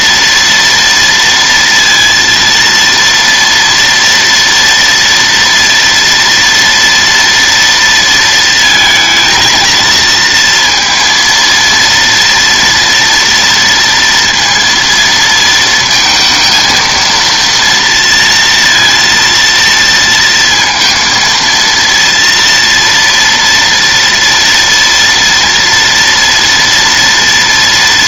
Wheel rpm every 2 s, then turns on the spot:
230, 230, 230, 230, 220, 230, 230, 230, 230, 230, 230, 230, 230, 230.
none